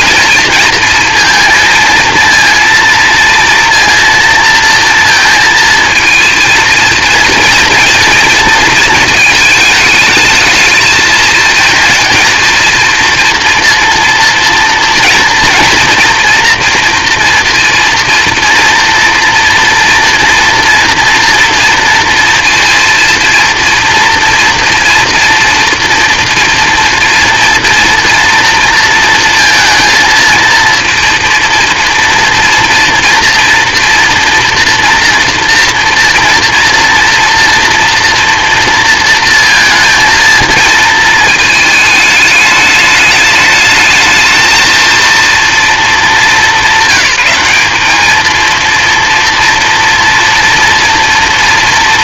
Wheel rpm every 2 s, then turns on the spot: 230, 230, 230, 230, 230, 220, 230, 230, 230, 230, 230, 230, 230, 230, 230, 230, 230, 230, 230, 230, 220, 210, 220, 200, 230, 230.
none